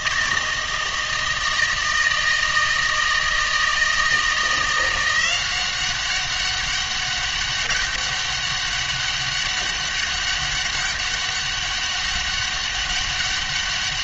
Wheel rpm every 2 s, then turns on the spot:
160, 160, 170, 200, 200, 200, 200.
none